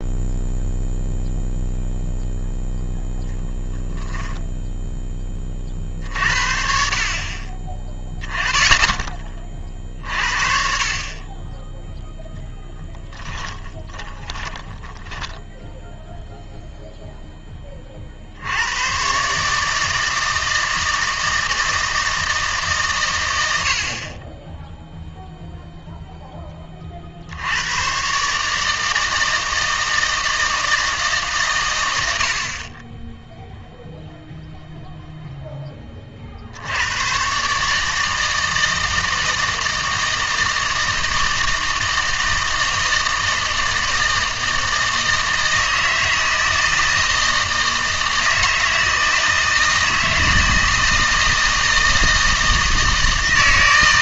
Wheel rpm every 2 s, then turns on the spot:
0, 0, 0, 40, 10, 40, 10, 10, 0, 90, 160, 140, 10, 30, 150, 160, 30, 0, 80, 160, 160, 160, 160, 160, 160, 160, 160.
12-16